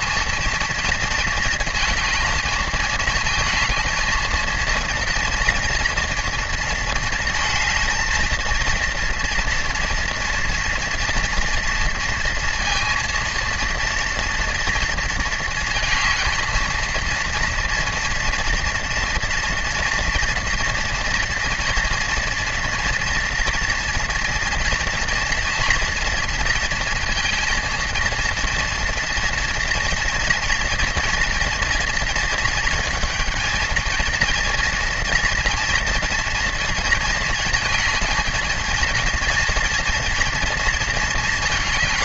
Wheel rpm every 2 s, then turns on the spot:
230, 220, 230, 230, 230, 230, 230, 230, 220, 230, 230, 230, 240, 230, 230, 230, 230, 230, 230, 220, 230.
none